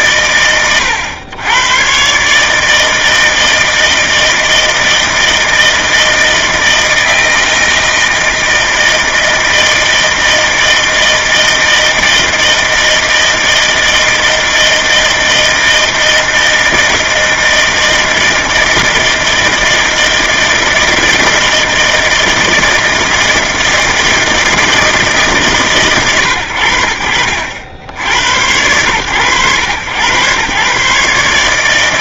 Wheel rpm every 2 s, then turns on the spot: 120, 140, 160, 160, 160, 160, 160, 160, 160, 160, 160, 160, 160, 110, 90, 110.
none